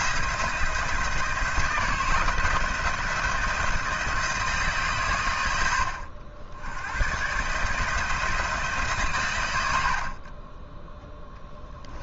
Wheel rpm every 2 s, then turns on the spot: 170, 170, 140, 100, 150, 10.
none